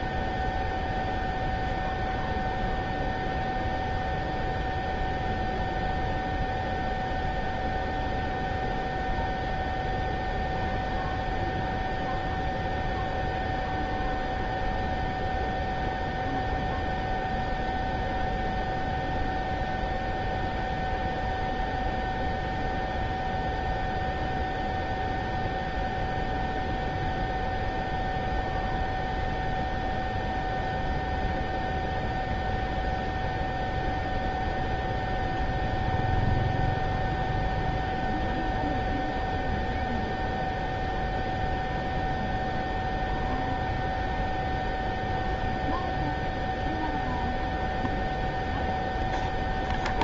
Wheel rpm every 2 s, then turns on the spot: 0, 0, 0, 0, 0, 0, 0, 0, 0, 0, 0, 0, 0, 0, 0, 0, 0, 0, 0, 0, 0, 0, 0, 0, 0.
none